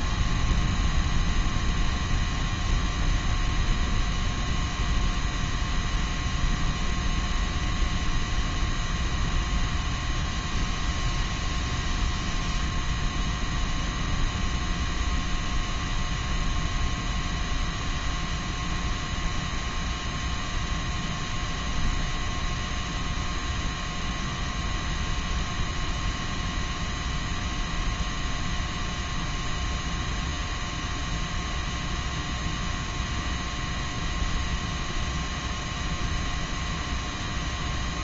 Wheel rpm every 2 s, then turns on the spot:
0, 0, 0, 0, 0, 0, 0, 0, 0, 0, 0, 0, 0, 0, 0, 0, 0, 0, 0.
none